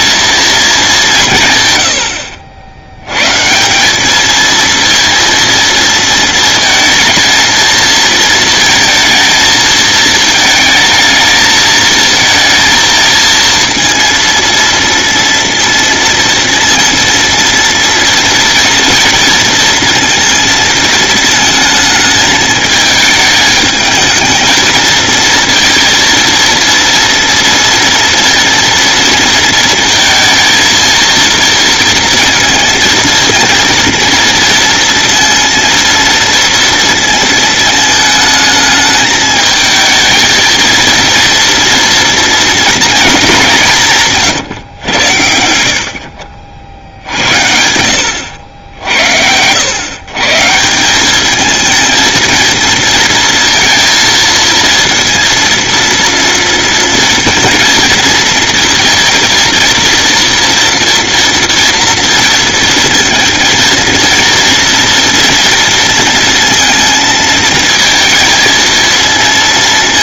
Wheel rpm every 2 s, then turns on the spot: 210, 90, 230, 220, 230, 220, 230, 230, 230, 230, 220, 210, 230, 240, 230, 230, 230, 230, 230, 220, 230, 230, 110, 70, 80, 170, 220, 230, 230, 230, 230, 230, 230, 230, 230.
none